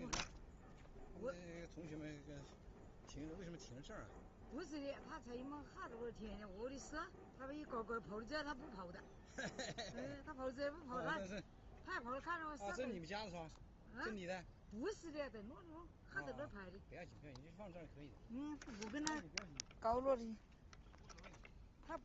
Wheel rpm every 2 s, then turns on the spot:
0, 0, 0, 0, 0, 0, 0, 0, 0, 0, 0.
none